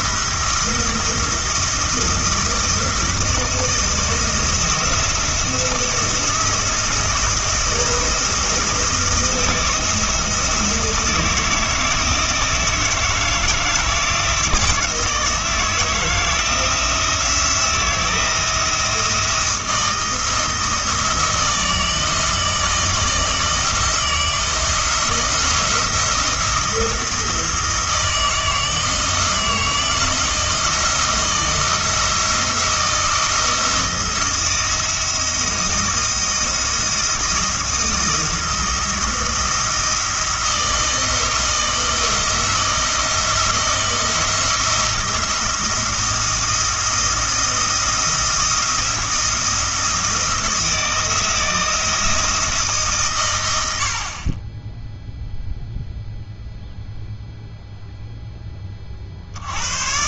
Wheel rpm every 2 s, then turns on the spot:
170, 170, 170, 160, 160, 160, 160, 170, 170, 170, 160, 160, 170, 170, 160, 170, 160, 170, 170, 170, 160, 160, 170, 170, 170, 160, 150, 10, 0, 30.
none